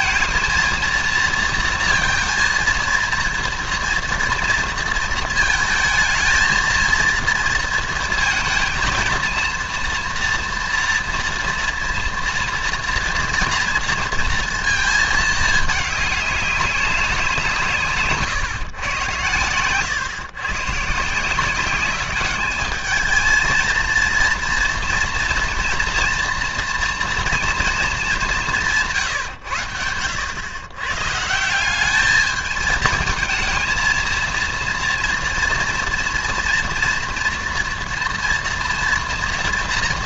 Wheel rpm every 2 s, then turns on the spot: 230, 230, 230, 230, 230, 240, 230, 230, 200, 130, 140, 210, 230, 240, 170, 120, 220, 230, 230, 230.
none